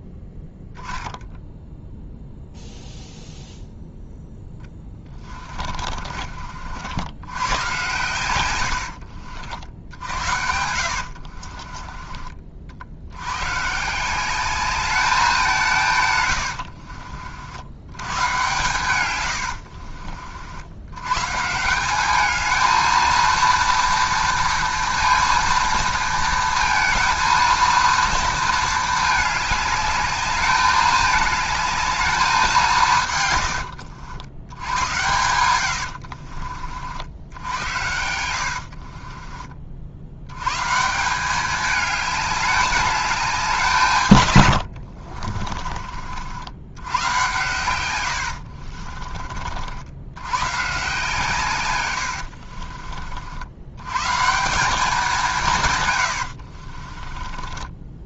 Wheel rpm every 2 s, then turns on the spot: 10, 0, 20, 70, 90, 70, 70, 210, 70, 120, 100, 220, 230, 230, 220, 210, 170, 90, 50, 50, 150, 200, 60, 90, 40, 140, 50, 190, 40.
4-6 8-12 16-18 38-40 44-46 48-50 56-58